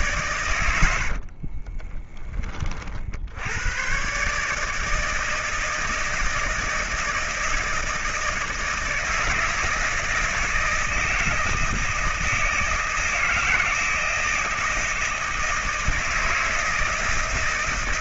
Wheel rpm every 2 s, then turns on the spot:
90, 50, 160, 160, 160, 160, 160, 160, 160.
0-2